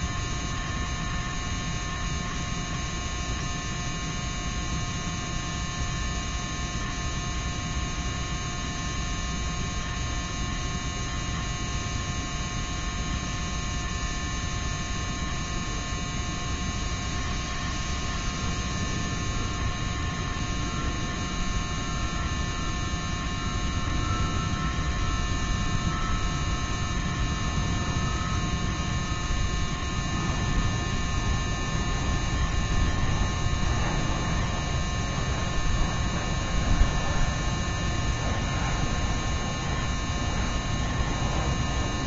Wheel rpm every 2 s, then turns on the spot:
0, 0, 0, 0, 0, 0, 0, 0, 0, 0, 0, 0, 0, 0, 0, 0, 0, 0, 0, 0, 0.
none